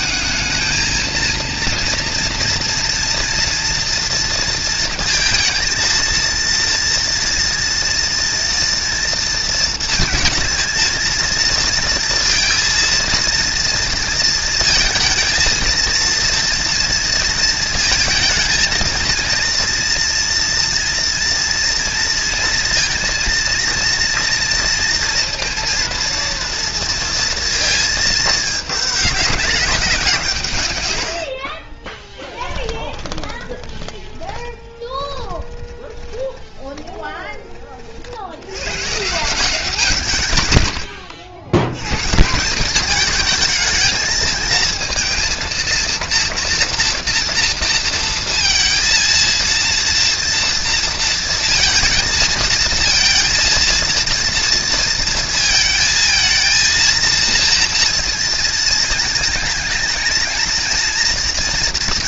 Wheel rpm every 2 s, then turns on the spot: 220, 230, 230, 230, 240, 220, 230, 230, 230, 220, 230, 230, 230, 230, 220, 160, 40, 20, 20, 90, 100, 170, 220, 230, 230, 230, 220, 230, 230, 230, 230.
32-38